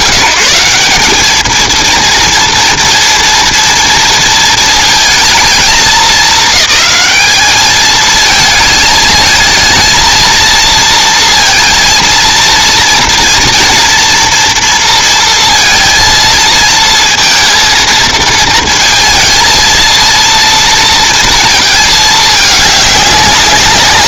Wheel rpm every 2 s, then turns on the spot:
180, 230, 230, 210, 220, 230, 230, 230, 230, 230, 230, 210.
none